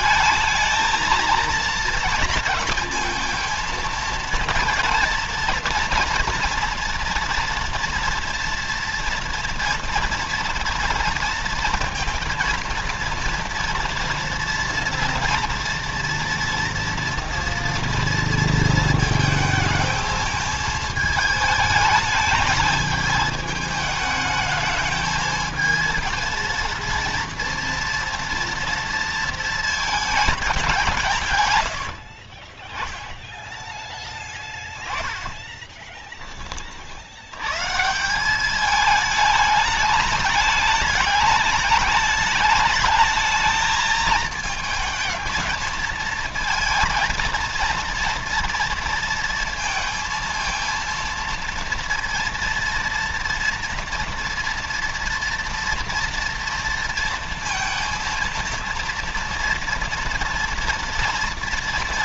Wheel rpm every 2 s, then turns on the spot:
220, 220, 230, 230, 230, 230, 230, 230, 230, 220, 220, 220, 220, 230, 230, 170, 10, 10, 60, 210, 210, 220, 220, 230, 230, 230, 230, 230, 230, 230, 230.
34-36